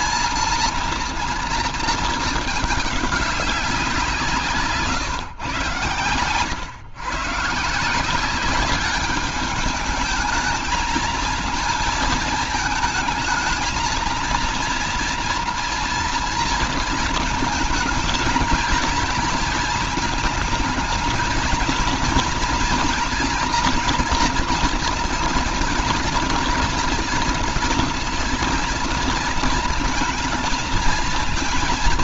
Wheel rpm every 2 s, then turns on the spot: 230, 210, 160, 130, 190, 220, 220, 230, 230, 220, 220, 230, 230, 240, 230, 230.
none